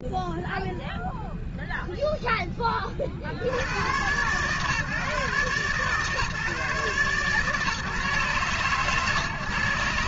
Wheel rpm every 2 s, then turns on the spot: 0, 10, 120, 130, 130.
none